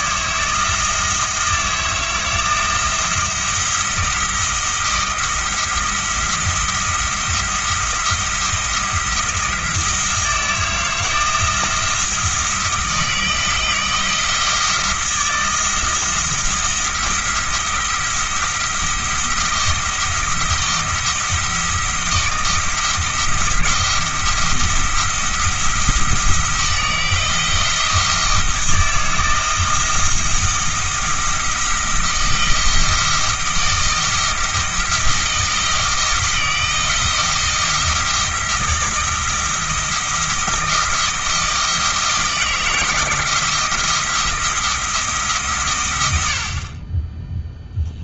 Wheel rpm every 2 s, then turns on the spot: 160, 170, 170, 170, 170, 160, 160, 160, 170, 170, 170, 170, 170, 160, 160, 170, 170, 170, 160, 170, 170, 170, 170, 40.
none